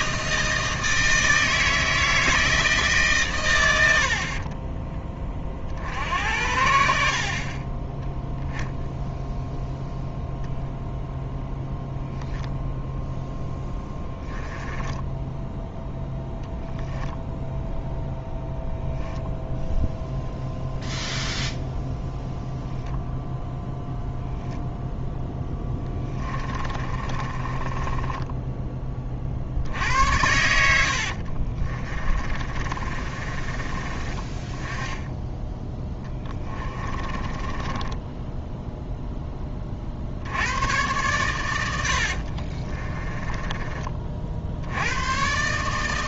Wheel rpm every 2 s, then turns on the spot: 160, 150, 20, 70, 0, 0, 0, 10, 0, 0, 0, 0, 0, 30, 20, 70, 30, 10, 20, 0, 110, 20, 90.
14-16 26-28 30-34 36-38 42-44